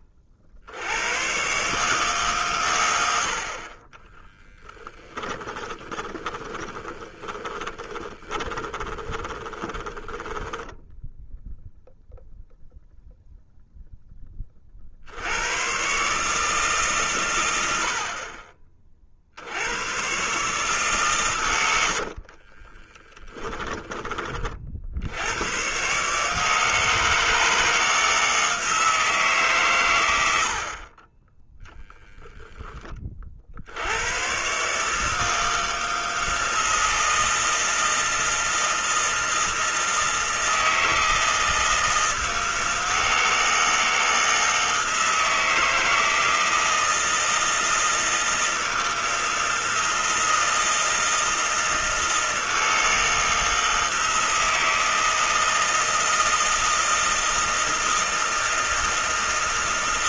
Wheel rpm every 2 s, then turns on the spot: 90, 100, 10, 20, 20, 10, 0, 50, 140, 30, 140, 20, 70, 160, 160, 40, 20, 140, 160, 160, 160, 160, 160, 160, 160, 160, 160, 160, 160, 160.
4-10 22-24